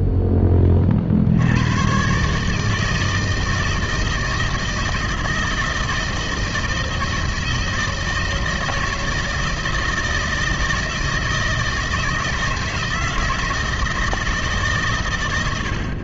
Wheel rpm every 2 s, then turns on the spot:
60, 160, 160, 160, 160, 160, 160, 60.
none